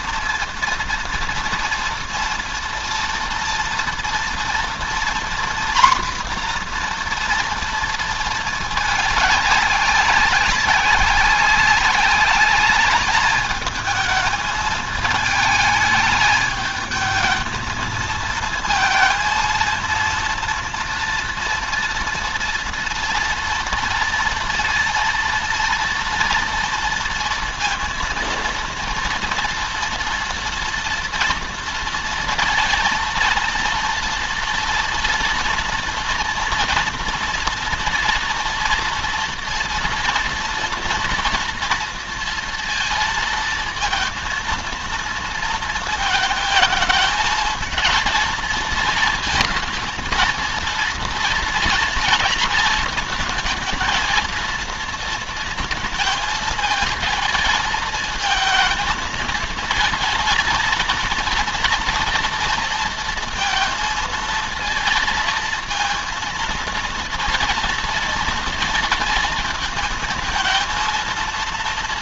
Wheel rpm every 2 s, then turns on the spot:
230, 230, 240, 240, 210, 190, 210, 210, 220, 230, 230, 230, 230, 230, 230, 240, 230, 240, 230, 230, 240, 230, 230, 220, 230, 230, 220, 230, 220, 220, 230, 230, 230, 230, 230, 230.
none